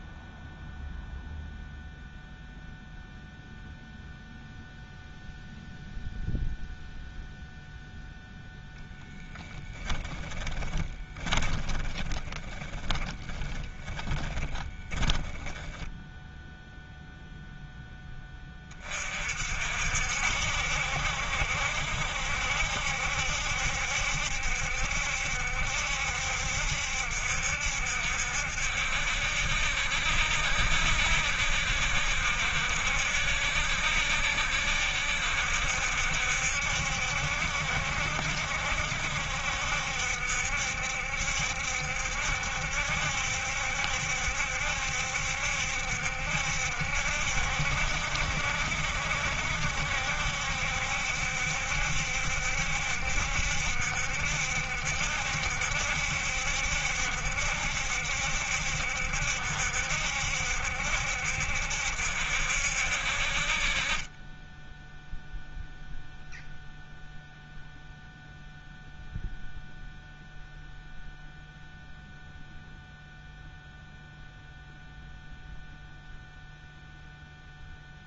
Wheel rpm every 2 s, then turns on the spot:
0, 0, 0, 0, 0, 20, 20, 20, 0, 30, 70, 70, 70, 70, 70, 70, 70, 70, 70, 70, 70, 70, 70, 70, 70, 70, 70, 70, 70, 70, 70, 60, 10, 0, 0, 0, 0, 0, 0.
10-16